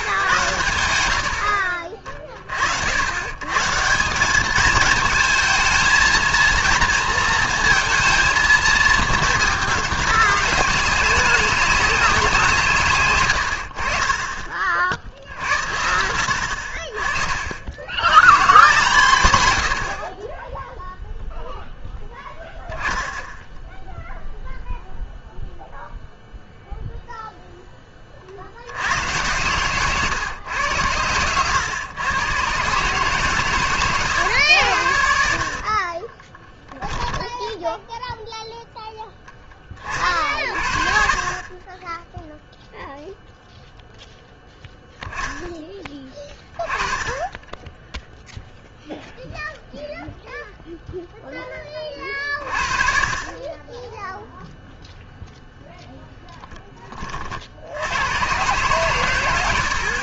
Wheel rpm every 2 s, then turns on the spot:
110, 60, 210, 230, 230, 200, 150, 40, 50, 150, 10, 0, 0, 0, 90, 110, 130, 80, 10, 0, 50, 0, 0, 20, 0, 0, 40, 0, 30, 120.
36-38